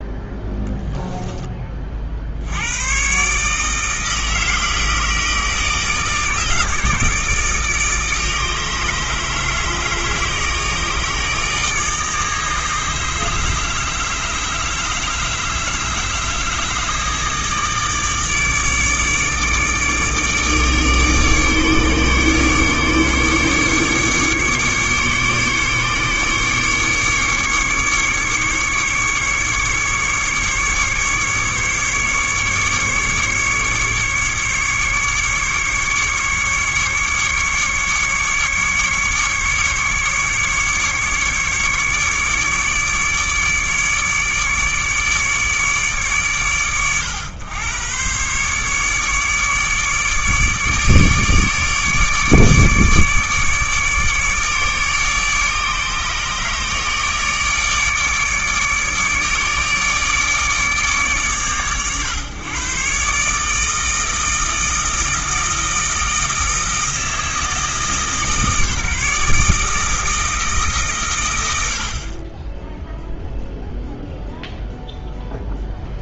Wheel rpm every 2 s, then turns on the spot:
10, 80, 160, 160, 160, 160, 150, 150, 160, 150, 150, 150, 140, 140, 150, 140, 150, 150, 150, 140, 150, 150, 150, 100, 140, 150, 150, 150, 150, 150, 150, 130, 160, 160, 150, 140, 10, 0.
0-2